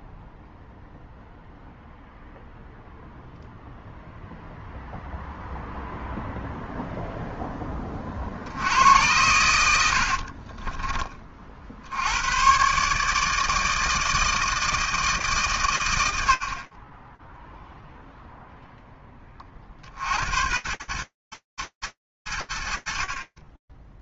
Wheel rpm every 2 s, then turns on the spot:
0, 0, 0, 0, 80, 20, 130, 160, 40, 0, 110, 90.
10-12